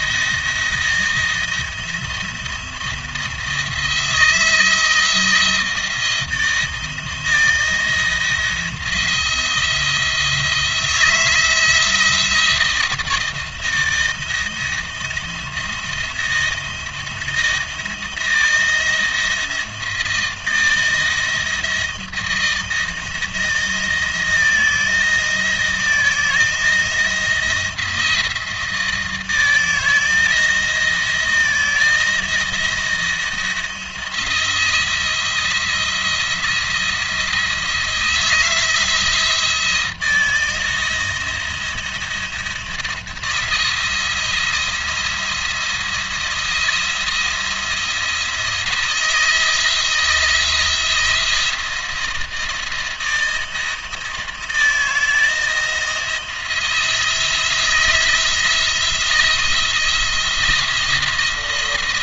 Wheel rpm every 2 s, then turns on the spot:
170, 160, 160, 170, 170, 170, 170, 170, 170, 170, 170, 170, 160, 170, 160, 160, 170, 170, 170, 170, 170, 170, 170, 170, 170, 170, 170, 160, 170, 170, 170.
none